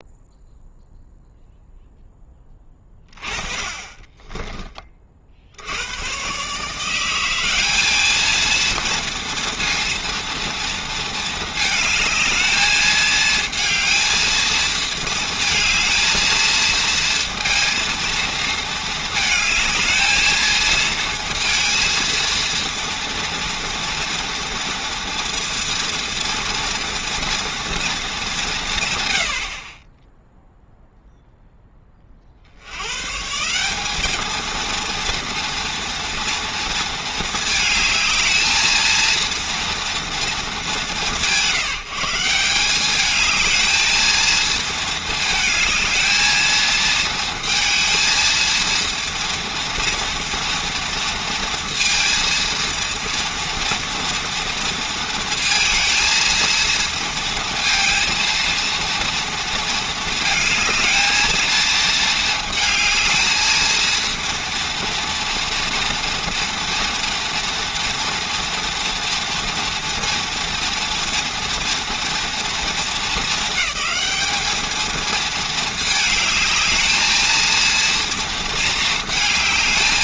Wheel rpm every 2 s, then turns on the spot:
0, 30, 30, 160, 230, 230, 220, 230, 230, 220, 220, 230, 230, 230, 160, 0, 100, 230, 230, 230, 170, 190, 220, 220, 230, 230, 230, 230, 230, 230, 220, 220, 230, 230, 230, 230, 230, 220, 210, 230.
none